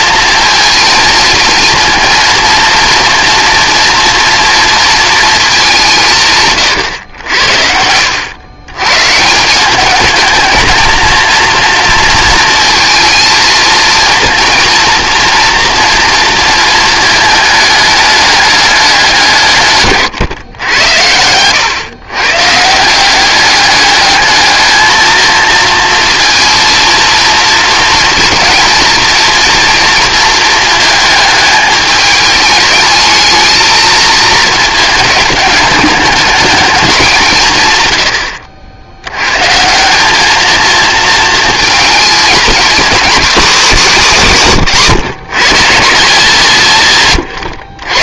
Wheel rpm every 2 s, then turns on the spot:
230, 230, 230, 110, 130, 230, 230, 230, 220, 200, 100, 160, 220, 230, 230, 220, 210, 220, 200, 80, 230, 240, 180, 150.
none